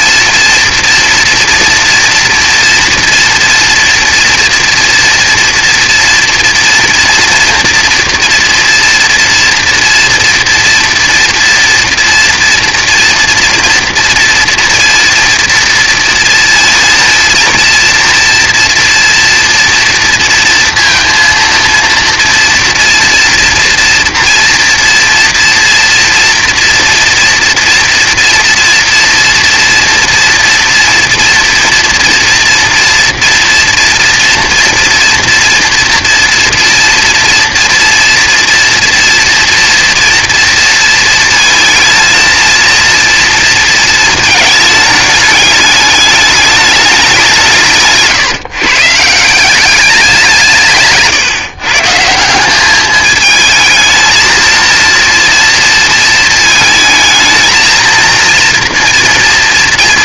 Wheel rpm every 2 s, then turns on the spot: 230, 230, 230, 230, 230, 230, 230, 230, 230, 230, 230, 230, 230, 230, 230, 230, 230, 230, 240, 240, 230, 230, 220, 210, 150, 150, 200, 230, 220, 230.
none